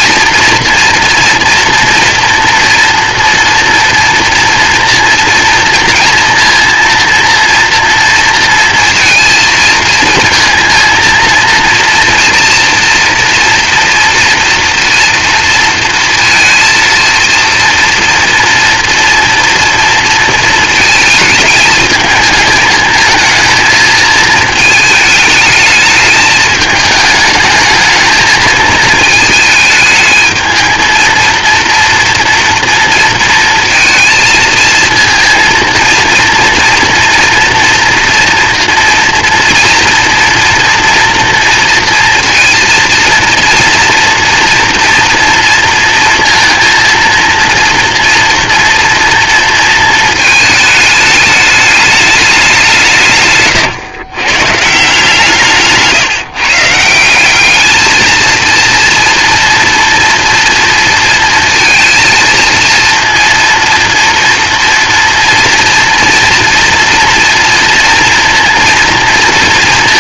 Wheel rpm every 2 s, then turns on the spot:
230, 230, 230, 230, 230, 230, 230, 230, 230, 230, 220, 220, 220, 210, 220, 230, 230, 230, 230, 230, 240, 230, 230, 230, 230, 220, 160, 160, 170, 230, 230, 230, 230, 230, 230.
none